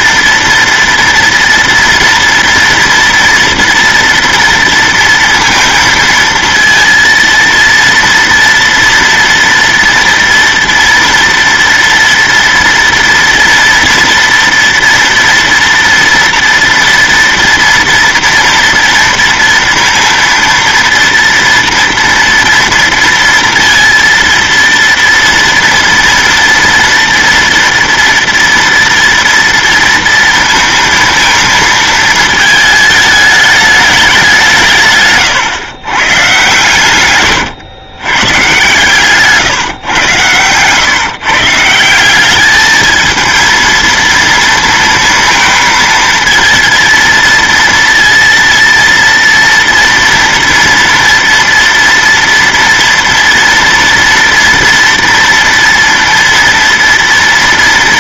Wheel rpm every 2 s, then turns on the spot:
230, 230, 230, 230, 230, 240, 240, 230, 230, 230, 230, 230, 230, 230, 230, 230, 220, 150, 120, 140, 130, 220, 230, 230, 230, 230, 230, 230, 230.
none